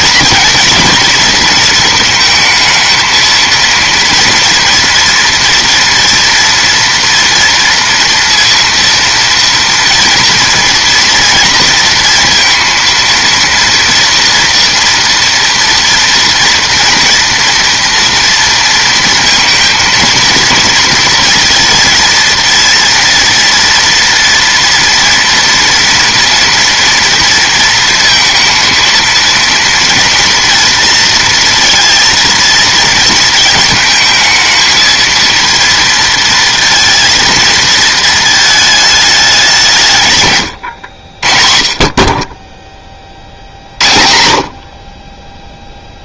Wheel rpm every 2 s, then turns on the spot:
230, 230, 240, 230, 230, 230, 230, 240, 230, 230, 230, 230, 230, 230, 230, 230, 230, 220, 230, 220, 90, 20, 60.
none